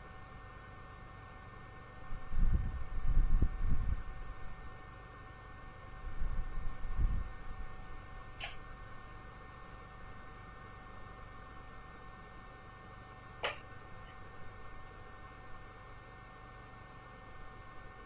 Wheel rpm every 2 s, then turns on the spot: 0, 0, 0, 0, 0, 0, 0, 0, 0.
none